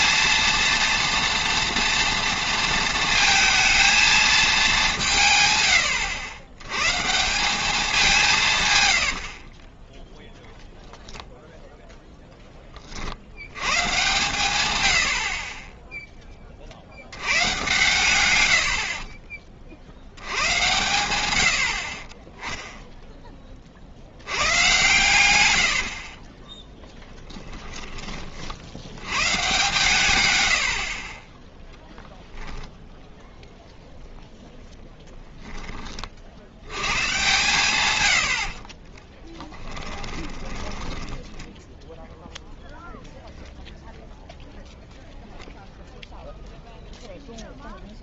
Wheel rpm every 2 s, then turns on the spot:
230, 230, 200, 120, 110, 10, 20, 100, 30, 80, 100, 10, 110, 10, 60, 80, 0, 0, 100, 50, 10, 0, 0, 0.
26-28 30-32 38-42